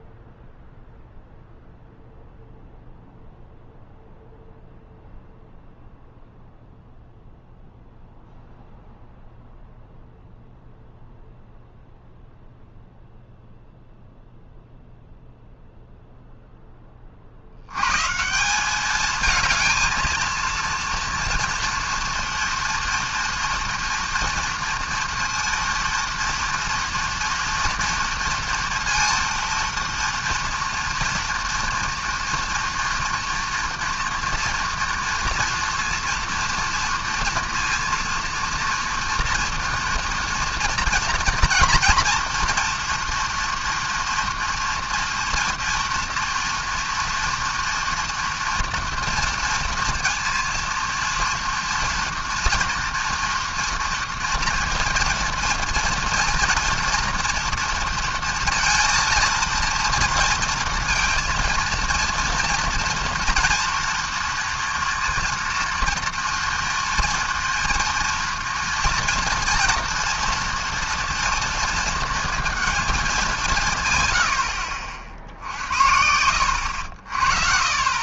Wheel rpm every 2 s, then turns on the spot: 0, 0, 0, 0, 0, 0, 0, 0, 10, 190, 230, 230, 230, 230, 230, 230, 230, 230, 230, 230, 230, 230, 240, 230, 230, 230, 240, 230, 230, 230, 230, 230, 230, 240, 230, 230, 220, 70, 80.
none